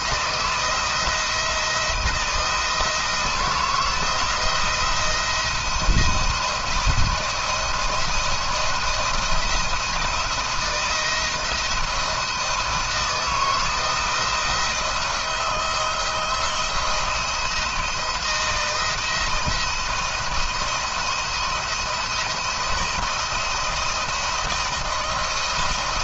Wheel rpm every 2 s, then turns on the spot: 170, 170, 170, 170, 170, 170, 160, 170, 170, 170, 170, 170, 160.
none